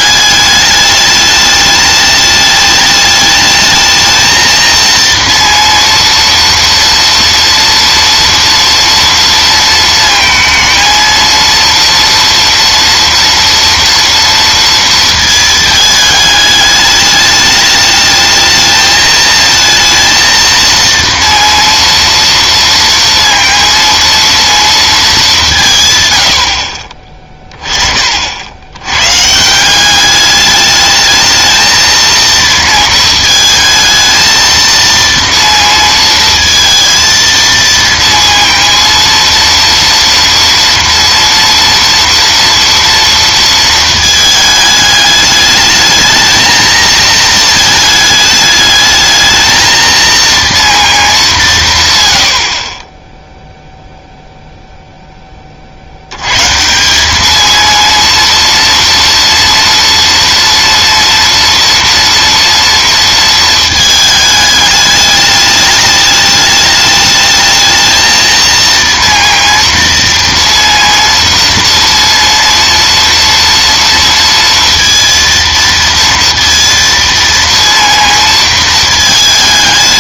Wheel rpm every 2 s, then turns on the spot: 210, 210, 230, 230, 230, 230, 230, 230, 210, 220, 230, 230, 230, 50, 100, 210, 230, 230, 230, 230, 230, 230, 210, 220, 210, 230, 30, 0, 160, 230, 230, 230, 210, 210, 230, 230, 240, 230, 230, 220.
none